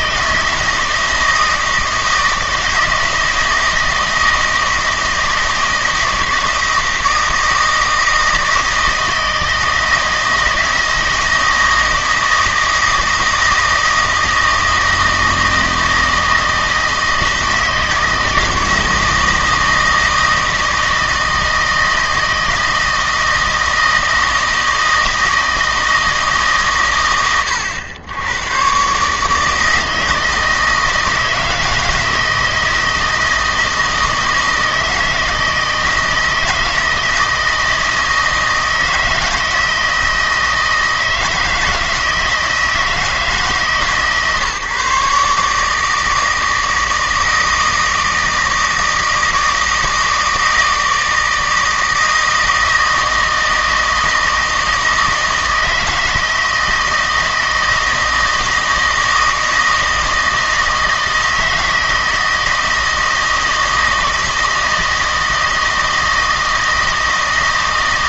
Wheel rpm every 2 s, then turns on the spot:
160, 160, 160, 160, 160, 160, 160, 160, 160, 160, 160, 160, 160, 120, 130, 160, 170, 160, 160, 160, 160, 160, 140, 160, 160, 160, 160, 160, 160, 160, 160, 160, 160, 160.
none